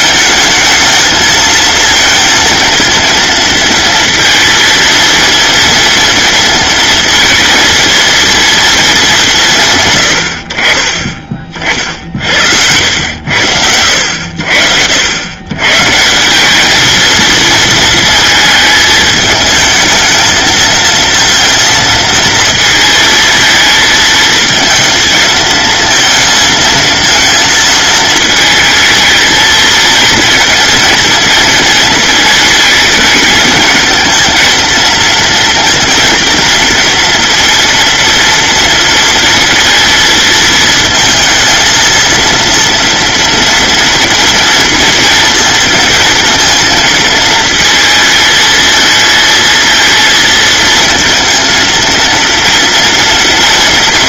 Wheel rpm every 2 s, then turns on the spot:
220, 230, 230, 220, 200, 40, 80, 100, 230, 220, 230, 220, 230, 230, 220, 230, 220, 230, 230, 230, 220, 230, 230, 230, 220, 230, 230.
none